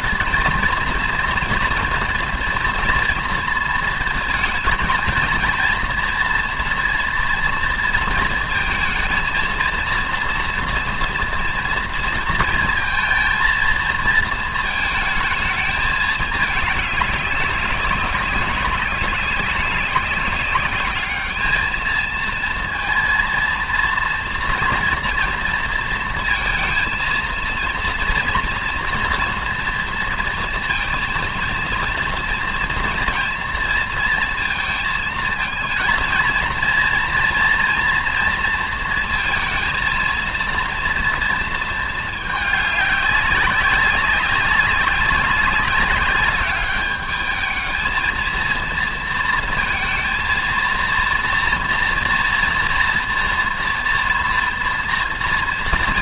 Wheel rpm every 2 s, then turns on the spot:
230, 240, 230, 230, 230, 230, 230, 220, 200, 200, 210, 230, 230, 230, 240, 230, 230, 220, 230, 230, 230, 200, 200, 210, 230, 230, 240, 230.
none